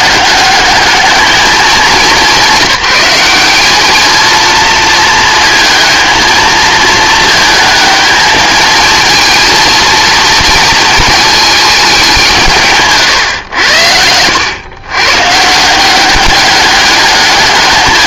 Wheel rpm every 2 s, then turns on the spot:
210, 190, 230, 220, 220, 230, 150, 110, 200.
none